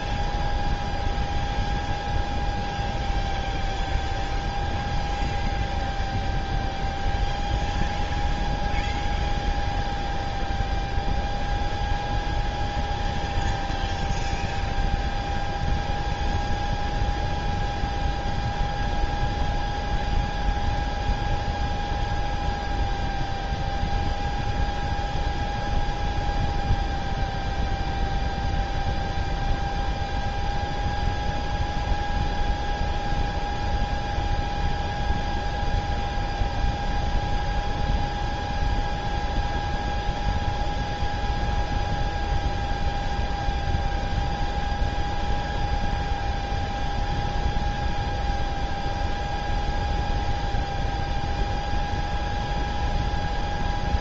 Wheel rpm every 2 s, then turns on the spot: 0, 0, 0, 0, 0, 0, 0, 0, 0, 0, 0, 0, 0, 0, 0, 0, 0, 0, 0, 0, 0, 0, 0, 0, 0, 0, 0.
none